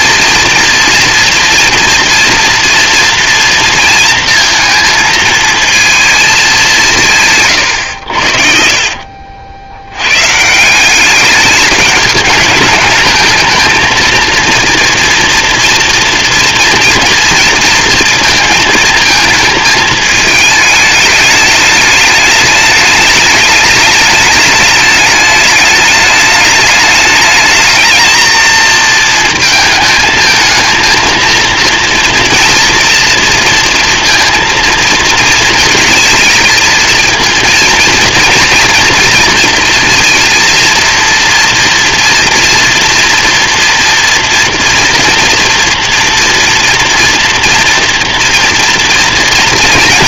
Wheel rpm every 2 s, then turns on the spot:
230, 230, 230, 190, 50, 190, 220, 240, 230, 220, 210, 210, 210, 210, 220, 230, 230, 230, 220, 230, 230, 230, 230, 230, 230.
none